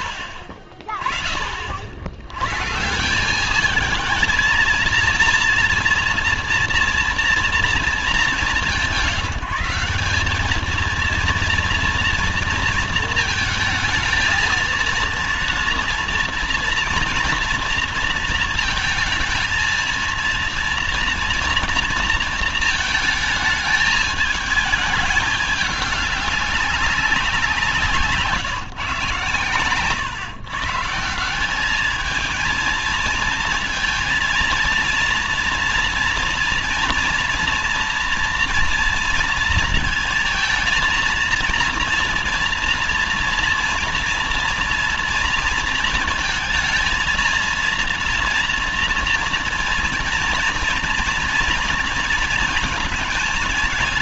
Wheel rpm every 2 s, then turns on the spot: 40, 130, 230, 230, 200, 220, 230, 220, 230, 230, 230, 220, 220, 190, 140, 140, 220, 230, 230, 230, 230, 230, 240, 230, 240, 230, 230.
none